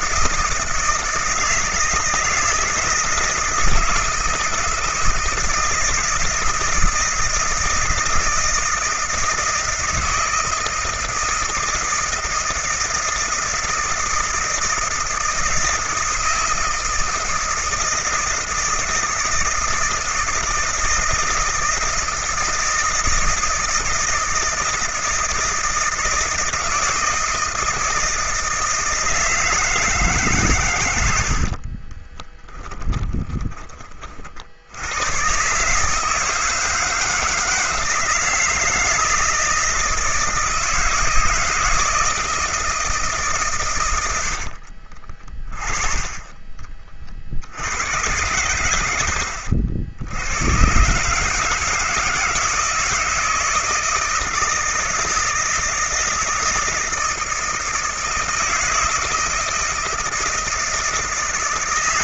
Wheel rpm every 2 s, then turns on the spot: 160, 160, 160, 160, 160, 160, 160, 160, 160, 160, 160, 160, 160, 160, 160, 130, 10, 70, 160, 160, 170, 160, 60, 30, 120, 120, 160, 160, 160, 160, 160.
32-34 44-46